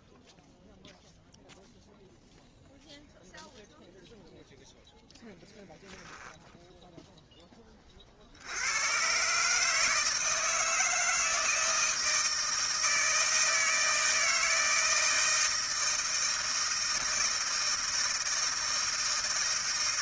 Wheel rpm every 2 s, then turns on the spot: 0, 0, 0, 10, 60, 160, 160, 160, 160, 160.
none